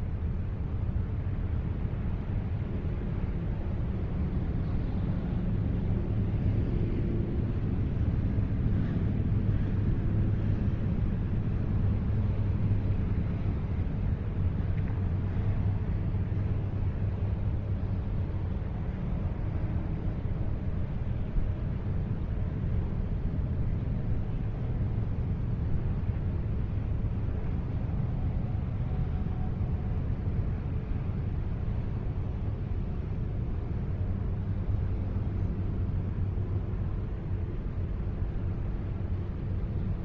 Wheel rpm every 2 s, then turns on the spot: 0, 0, 0, 0, 0, 0, 0, 0, 0, 0, 0, 0, 0, 0, 0, 0, 0, 0, 0, 0.
none